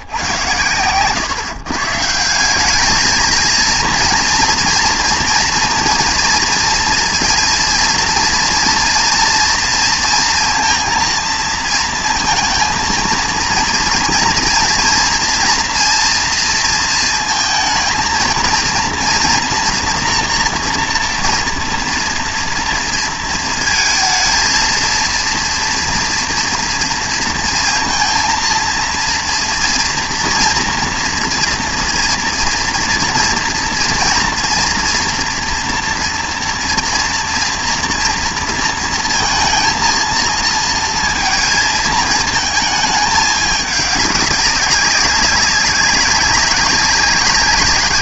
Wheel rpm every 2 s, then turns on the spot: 110, 190, 240, 230, 230, 230, 220, 230, 230, 230, 240, 230, 230, 230, 230, 230, 230, 240, 230, 230, 230, 220, 200, 200.
none